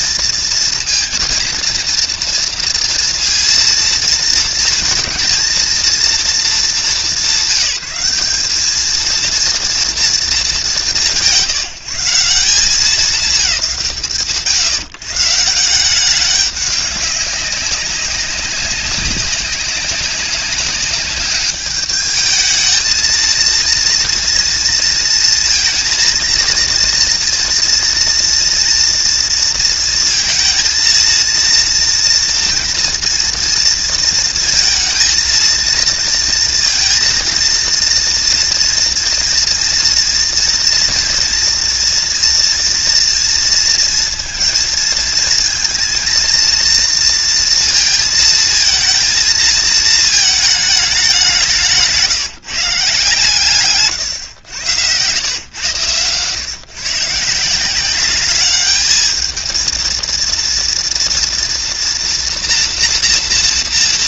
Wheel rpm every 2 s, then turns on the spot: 230, 230, 230, 210, 210, 180, 180, 140, 200, 190, 200, 220, 230, 230, 230, 230, 230, 220, 230, 230, 230, 230, 230, 230, 230, 210, 160, 100, 140, 210, 230, 240.
none